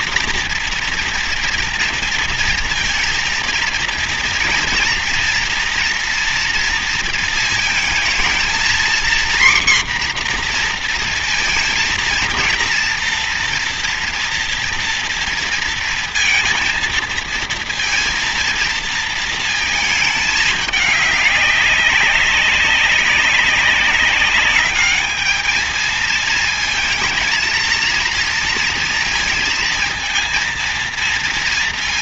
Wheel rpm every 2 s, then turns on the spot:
240, 230, 230, 230, 230, 250, 230, 230, 230, 230, 210, 200, 200, 220, 230, 230.
none